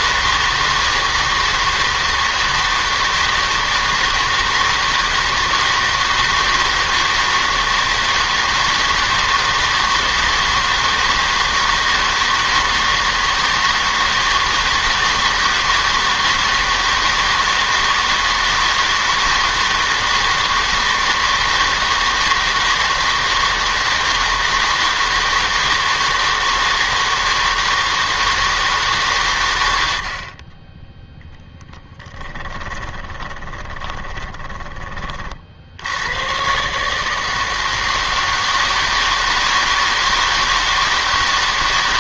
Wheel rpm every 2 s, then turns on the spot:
160, 160, 160, 160, 160, 160, 160, 160, 160, 160, 160, 160, 160, 160, 160, 30, 20, 20, 130, 160, 160.
32-36